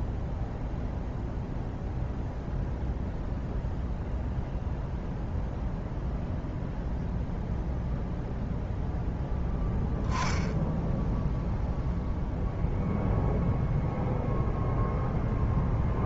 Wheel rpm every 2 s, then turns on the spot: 0, 0, 0, 0, 0, 0, 0, 0.
none